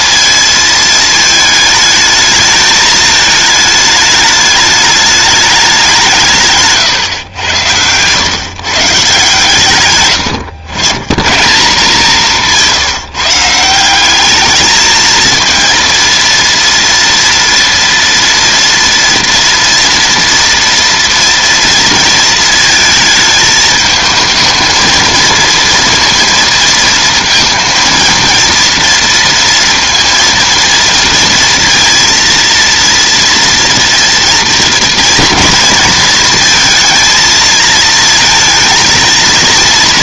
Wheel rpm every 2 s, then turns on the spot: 220, 220, 210, 150, 140, 110, 160, 210, 230, 240, 240, 230, 220, 230, 230, 230, 230, 230, 230, 230.
6-8 12-14